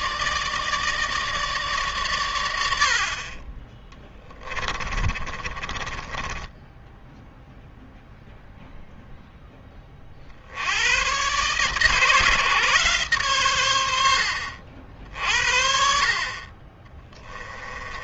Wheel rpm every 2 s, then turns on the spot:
160, 100, 20, 10, 0, 70, 140, 70, 40.
4-8